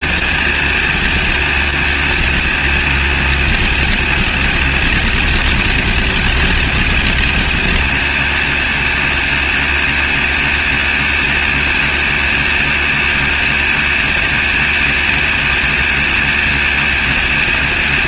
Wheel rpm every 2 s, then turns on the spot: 110, 110, 100, 100, 100, 100, 100, 100, 110.
none